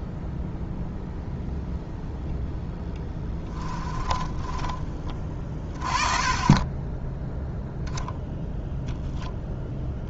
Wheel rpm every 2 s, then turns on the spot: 0, 10, 20, 10, 0.
2-4